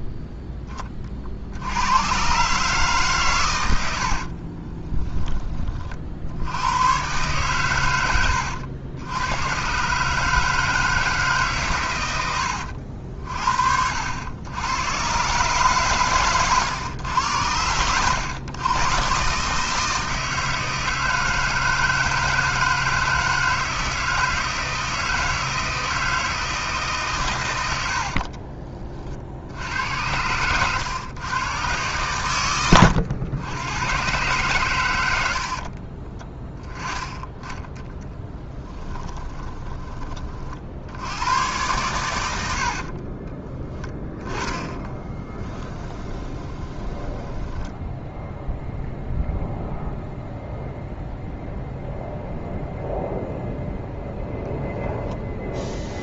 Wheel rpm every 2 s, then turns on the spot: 20, 140, 30, 120, 80, 160, 70, 110, 100, 120, 160, 160, 160, 150, 40, 120, 100, 100, 10, 10, 70, 40, 20, 20, 0, 0, 0, 10.
4-6 38-40 42-48